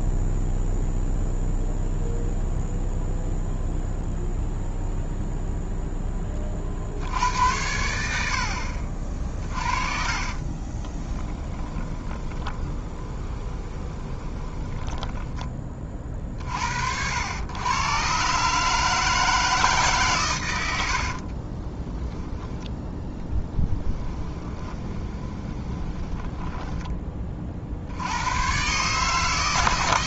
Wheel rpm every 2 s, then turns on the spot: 0, 0, 0, 80, 40, 20, 20, 30, 70, 160, 60, 0, 20, 20, 140.
10-16 20-22 24-26